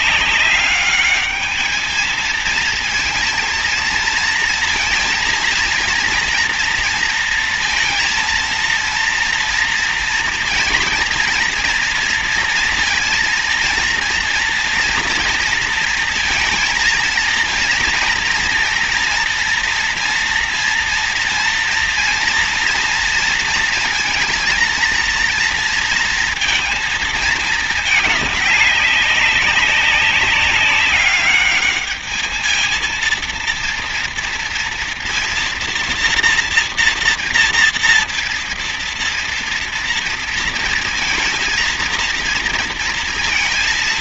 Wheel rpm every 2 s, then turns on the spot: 200, 220, 230, 230, 230, 230, 230, 230, 230, 230, 230, 230, 230, 230, 200, 200, 220, 230, 230, 230, 230, 230.
none